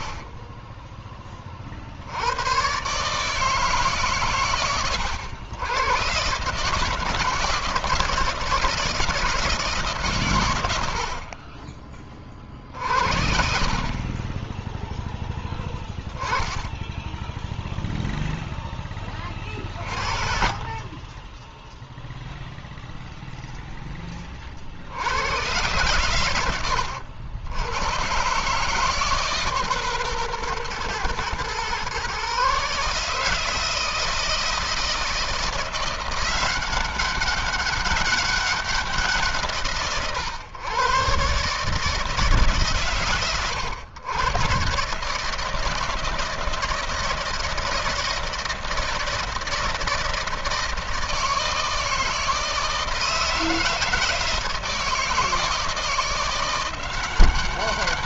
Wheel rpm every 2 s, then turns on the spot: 10, 130, 110, 150, 160, 100, 50, 10, 10, 10, 20, 0, 80, 90, 150, 120, 150, 160, 190, 180, 120, 140, 140, 160, 160, 160, 160, 160, 180.
16-18